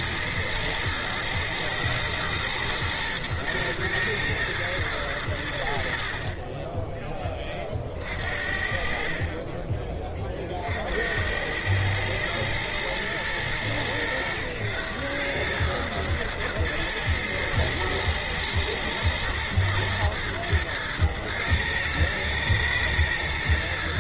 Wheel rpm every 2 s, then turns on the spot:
110, 120, 110, 30, 50, 50, 110, 110, 110, 110, 110, 110.
none